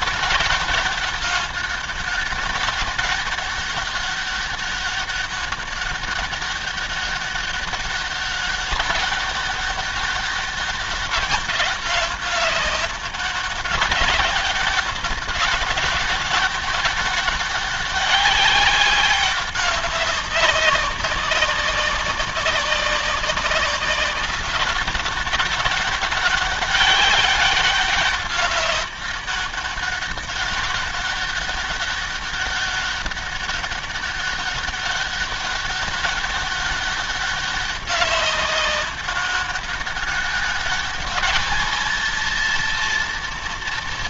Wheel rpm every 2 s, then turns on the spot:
200, 200, 200, 200, 200, 200, 190, 200, 200, 200, 200, 190, 200, 200, 200, 200, 200, 200, 200, 200, 200, 230.
none